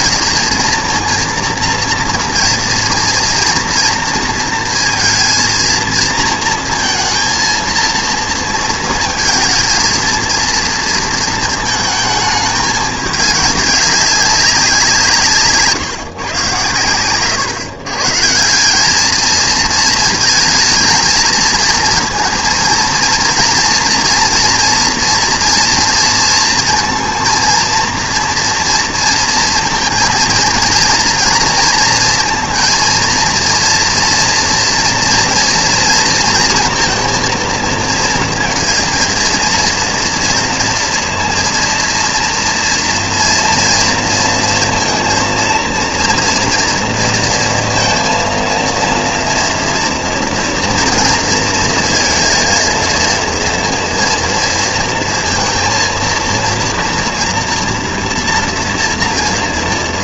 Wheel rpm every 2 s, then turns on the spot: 220, 230, 230, 230, 220, 230, 210, 180, 120, 180, 220, 230, 230, 230, 230, 230, 230, 230, 230, 230, 230, 230, 230, 230, 230, 230, 230, 230, 230, 230.
none